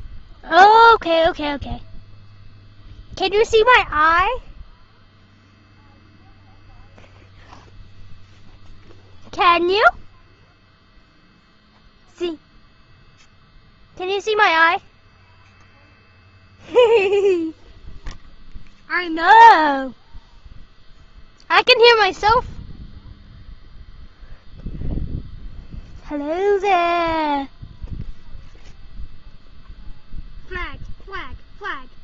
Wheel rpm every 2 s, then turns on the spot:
0, 0, 0, 0, 0, 0, 0, 0, 0, 0, 0, 0, 0, 0, 0, 0.
none